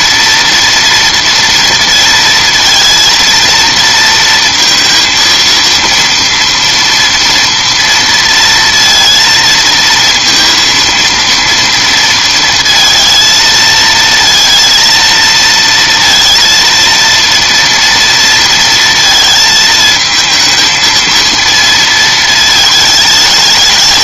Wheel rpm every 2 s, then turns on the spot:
230, 230, 230, 230, 230, 230, 230, 230, 230, 230, 220, 220.
none